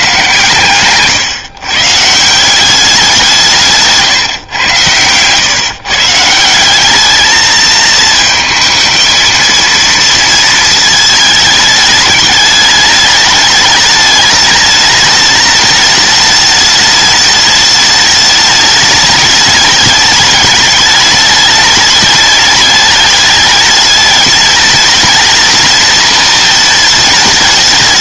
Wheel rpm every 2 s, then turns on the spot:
130, 180, 120, 180, 220, 230, 210, 210, 210, 210, 210, 210, 210, 220.
none